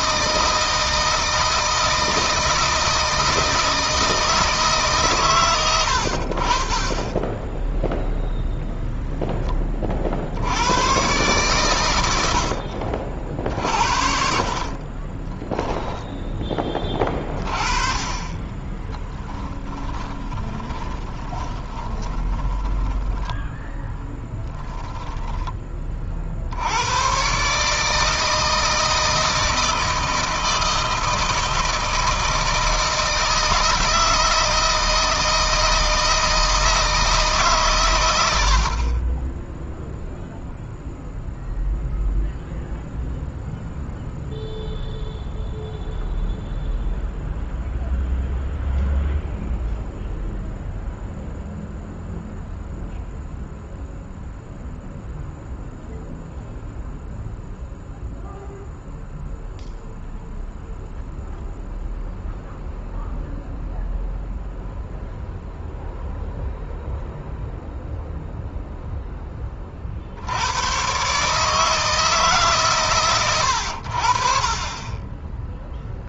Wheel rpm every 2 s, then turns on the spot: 160, 160, 140, 30, 0, 100, 60, 30, 20, 20, 20, 30, 0, 100, 160, 160, 160, 160, 160, 40, 0, 0, 0, 0, 0, 0, 0, 0, 0, 0, 0, 0, 0, 0, 10, 120, 130, 20.
6-8 14-16 18-24